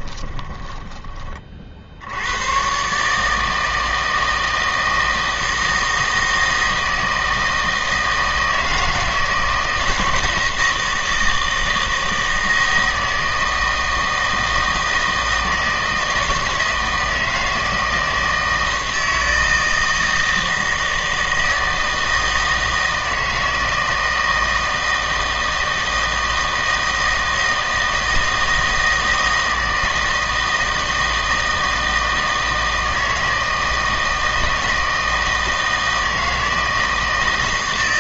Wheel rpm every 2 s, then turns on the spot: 20, 120, 160, 160, 160, 160, 160, 160, 160, 160, 160, 160, 160, 160, 160, 160, 160, 160, 160.
0-2